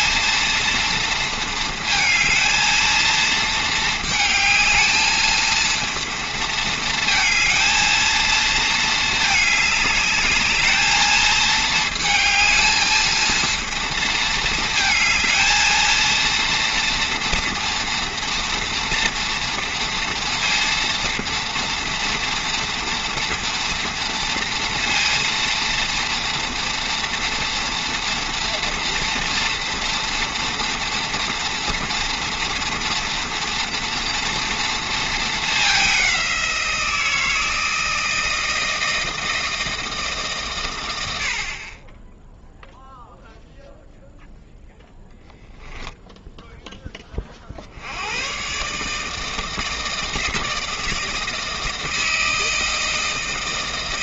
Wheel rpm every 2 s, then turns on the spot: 230, 230, 220, 220, 220, 220, 220, 220, 230, 230, 230, 230, 230, 230, 230, 240, 230, 230, 170, 160, 100, 0, 0, 20, 150, 160, 160.
none